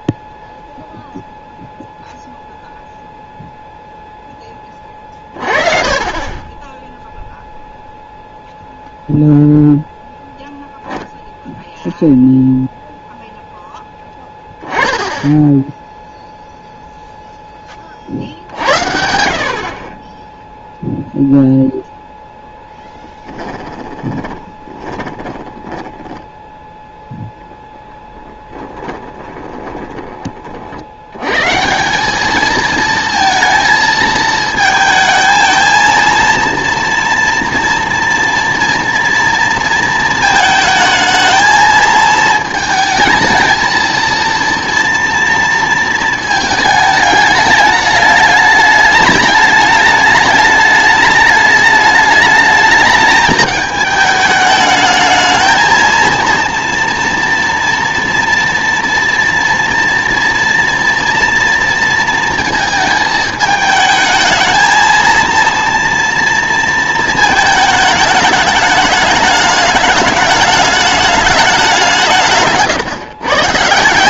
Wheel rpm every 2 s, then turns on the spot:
0, 0, 20, 10, 0, 0, 0, 10, 0, 70, 0, 10, 20, 0, 10, 50, 220, 220, 230, 230, 220, 220, 230, 220, 210, 210, 210, 210, 230, 230, 230, 230, 220, 230, 210, 210, 150.
24-26 28-30